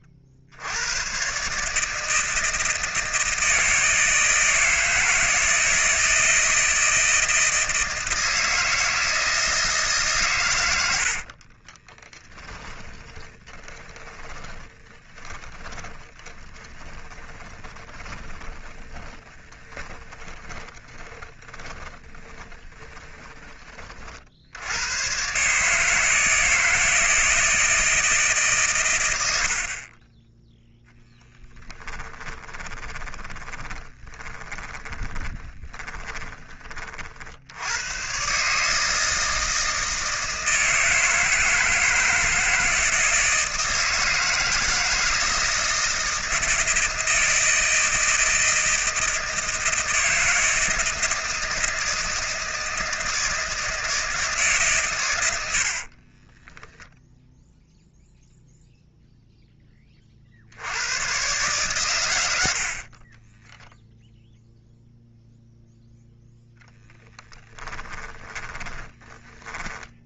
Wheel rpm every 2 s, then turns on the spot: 90, 160, 160, 160, 160, 90, 20, 20, 20, 20, 20, 20, 90, 160, 120, 10, 20, 10, 40, 150, 160, 160, 160, 160, 160, 170, 160, 140, 10, 0, 90, 60, 0, 10, 20.
10-24 32-36 56-58 62-64 66-70